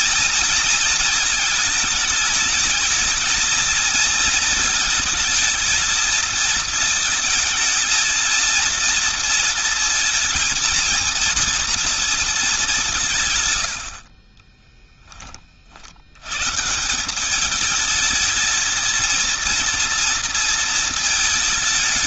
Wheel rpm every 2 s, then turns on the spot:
220, 220, 220, 230, 230, 230, 180, 10, 170, 230, 220.
none